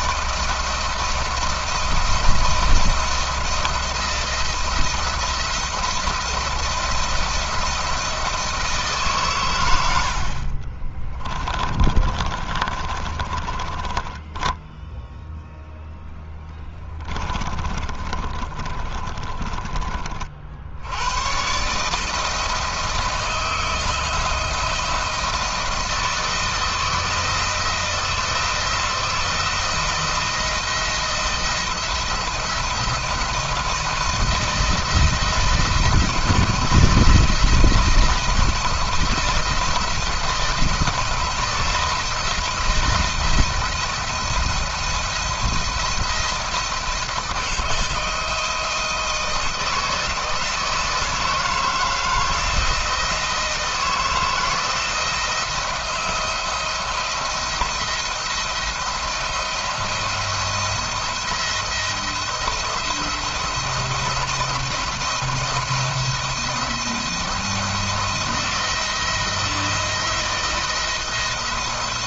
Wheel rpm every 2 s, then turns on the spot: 160, 170, 170, 170, 160, 50, 30, 10, 10, 40, 70, 160, 170, 160, 170, 170, 170, 160, 170, 160, 160, 170, 170, 170, 160, 160, 170, 160, 170, 170, 170, 170, 170, 170, 160, 170.
10-20